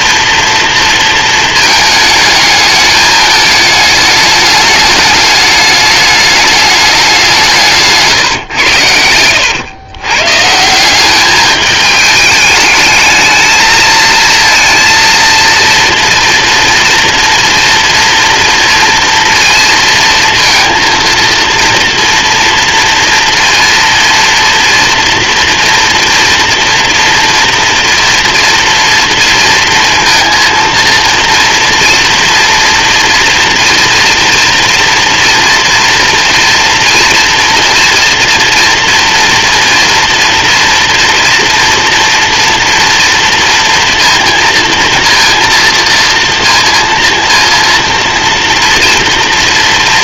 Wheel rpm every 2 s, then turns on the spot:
230, 210, 210, 210, 100, 190, 210, 230, 230, 230, 230, 230, 230, 230, 230, 230, 230, 230, 230, 230, 230, 230, 230, 230, 230.
none